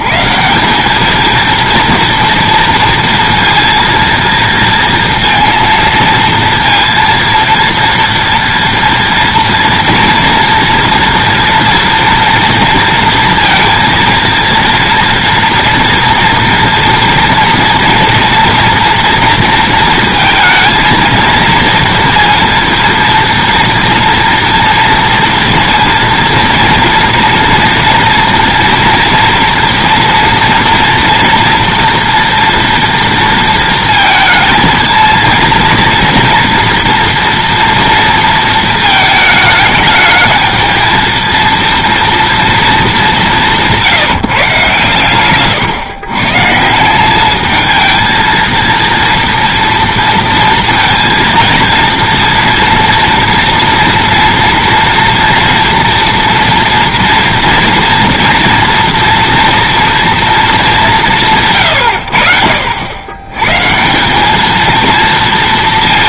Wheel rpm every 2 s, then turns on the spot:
170, 230, 230, 230, 230, 230, 230, 230, 230, 240, 230, 230, 230, 230, 230, 230, 230, 220, 230, 220, 220, 230, 140, 150, 230, 230, 230, 230, 230, 230, 210, 70, 220.
none